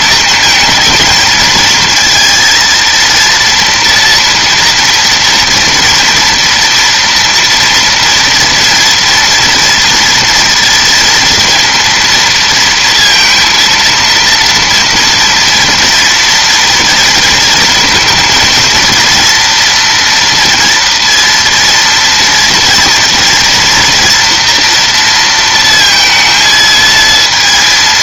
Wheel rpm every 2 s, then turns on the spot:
220, 230, 230, 230, 230, 230, 230, 230, 230, 230, 230, 230, 230, 230.
none